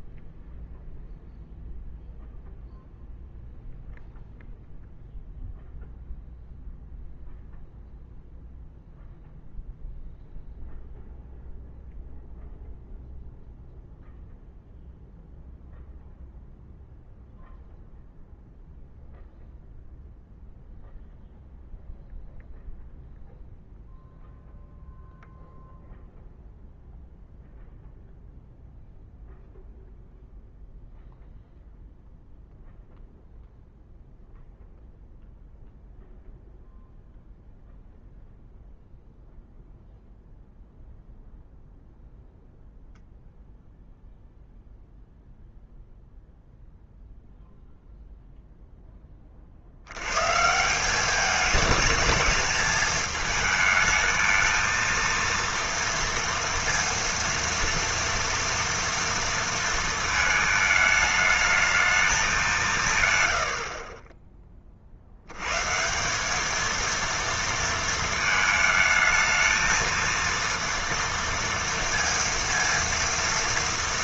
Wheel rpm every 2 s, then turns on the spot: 0, 0, 0, 0, 0, 0, 0, 0, 0, 0, 0, 0, 0, 0, 0, 0, 0, 0, 0, 0, 0, 0, 0, 0, 0, 170, 220, 230, 230, 230, 220, 170, 30, 220, 220, 230, 230.
none